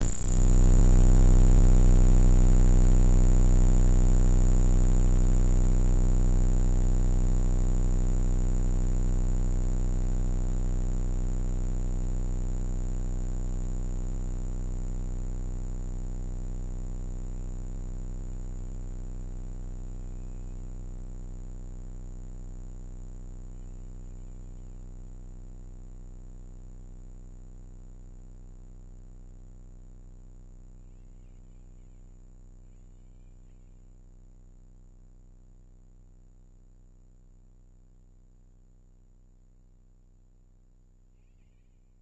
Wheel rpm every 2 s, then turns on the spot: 0, 0, 50, 50, 0, 0, 20, 0, 30, 190, 80, 60, 50, 10, 10, 80, 80, 0, 0, 0, 30.
12-14 20-22 24-28